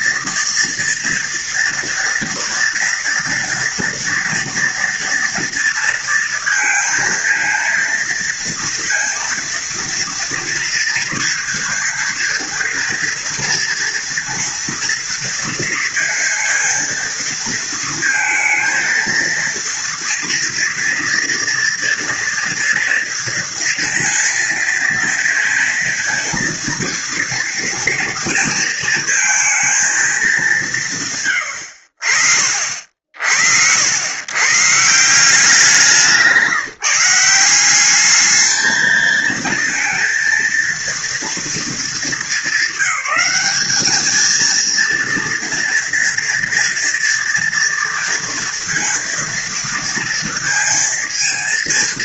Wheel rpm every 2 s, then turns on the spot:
230, 230, 240, 230, 230, 230, 230, 230, 230, 230, 230, 230, 230, 230, 230, 190, 60, 130, 160, 220, 230, 200, 220, 230, 230, 230.
none